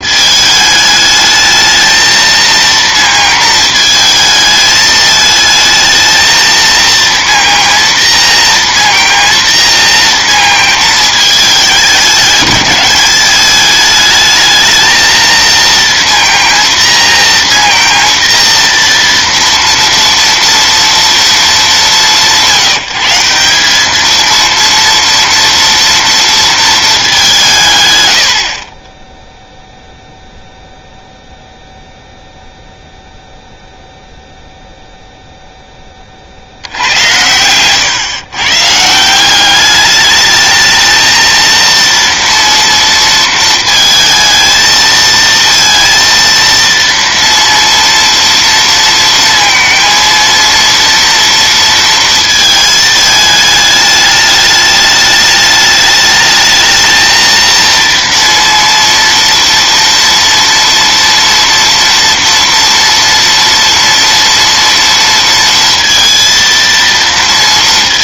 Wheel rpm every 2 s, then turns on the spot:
220, 230, 220, 230, 230, 230, 200, 220, 230, 230, 230, 170, 230, 220, 30, 0, 0, 0, 80, 150, 220, 230, 220, 230, 230, 230, 220, 210, 220, 230, 230, 230, 230, 230.
none